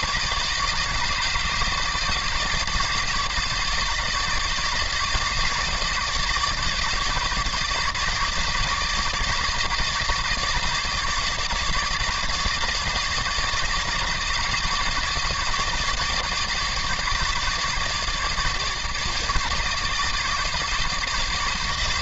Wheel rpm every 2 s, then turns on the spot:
150, 150, 150, 150, 150, 150, 150, 150, 150, 150, 150.
none